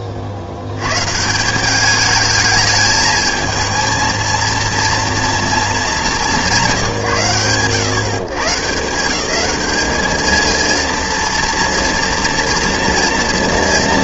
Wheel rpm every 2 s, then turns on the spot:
70, 220, 230, 170, 160, 230, 230.
none